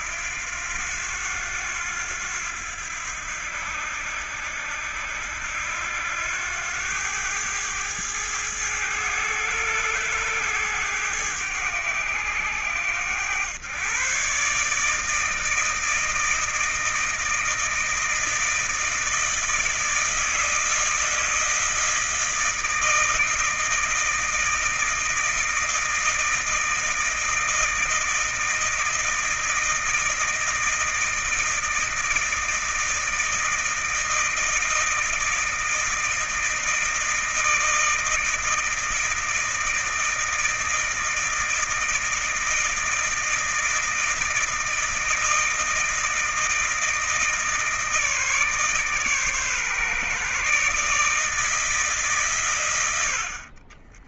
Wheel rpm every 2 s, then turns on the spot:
80, 90, 80, 90, 100, 100, 90, 140, 160, 160, 160, 160, 160, 160, 160, 160, 160, 160, 160, 160, 160, 160, 160, 160, 150, 140, 120.
none